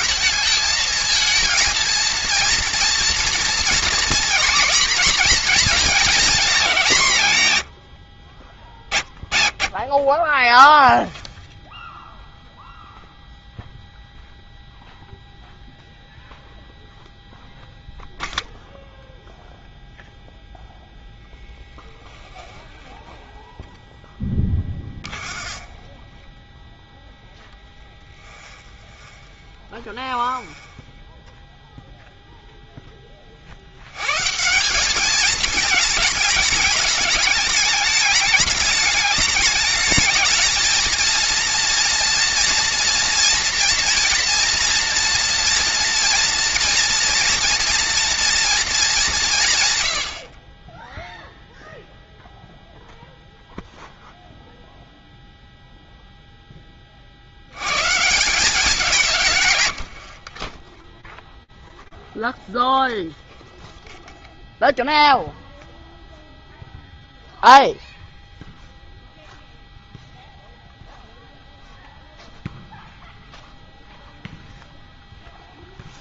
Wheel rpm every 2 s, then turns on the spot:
220, 230, 240, 200, 30, 0, 0, 0, 0, 0, 0, 0, 20, 10, 20, 20, 0, 170, 210, 210, 220, 230, 230, 240, 220, 20, 0, 0, 10, 180, 20, 0, 0, 0, 0, 0, 0, 0.
24-32 60-62